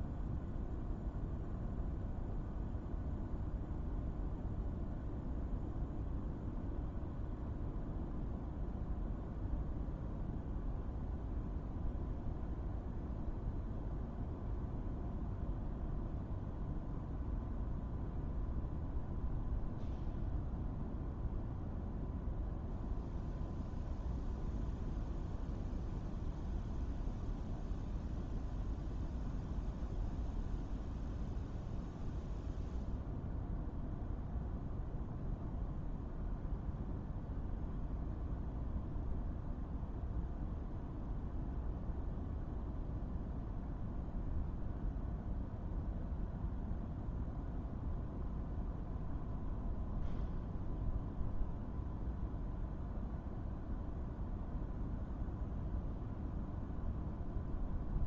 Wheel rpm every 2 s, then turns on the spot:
0, 0, 0, 0, 0, 0, 0, 0, 0, 0, 0, 0, 0, 0, 0, 0, 0, 0, 0, 0, 0, 0, 0, 0, 0, 0, 0, 0, 0.
none